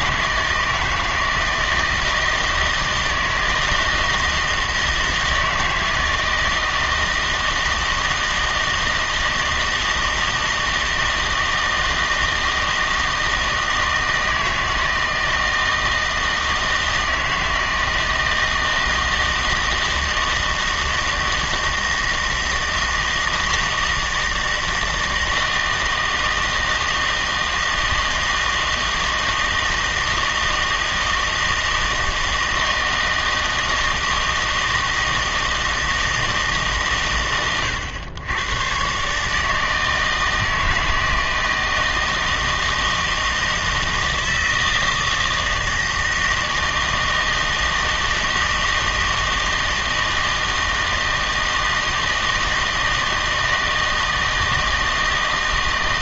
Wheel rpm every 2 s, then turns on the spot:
160, 160, 160, 160, 160, 160, 160, 160, 160, 160, 160, 160, 160, 160, 160, 160, 160, 160, 150, 120, 160, 160, 160, 160, 160, 160, 160, 160.
none